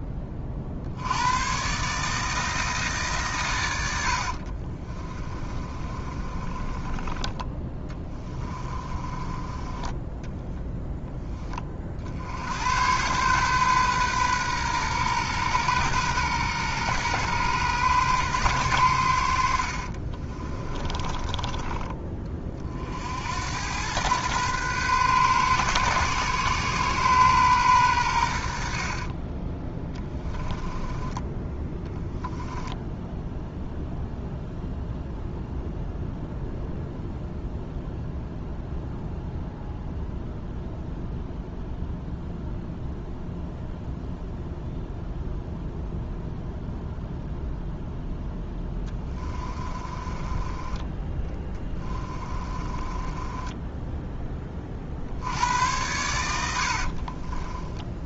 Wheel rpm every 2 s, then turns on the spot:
50, 150, 40, 20, 20, 0, 100, 120, 120, 100, 20, 50, 130, 130, 60, 10, 10, 0, 0, 0, 0, 0, 0, 0, 10, 20, 20, 50, 60.
4-10 20-22 30-32 48-54 56-58